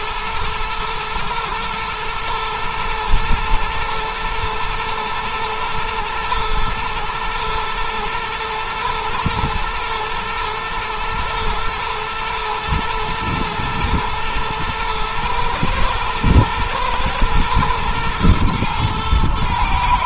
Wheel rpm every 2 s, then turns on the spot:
110, 110, 120, 110, 120, 120, 110, 110, 110, 110.
none